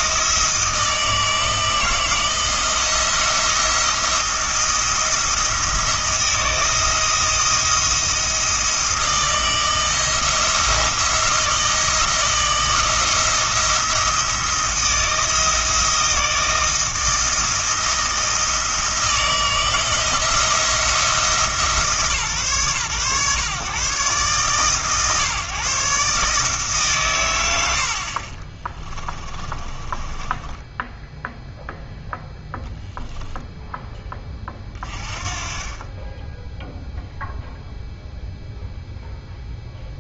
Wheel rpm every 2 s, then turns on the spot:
160, 160, 170, 160, 160, 160, 160, 170, 160, 160, 170, 130, 140, 140, 20, 10, 0, 30, 0, 0.
28-32